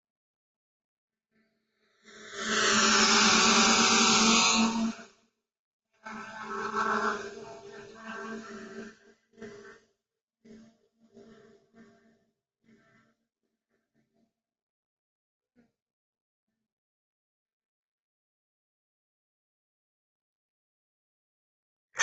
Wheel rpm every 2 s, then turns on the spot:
0, 0, 0, 0, 0, 0, 0, 0, 0, 0, 0.
none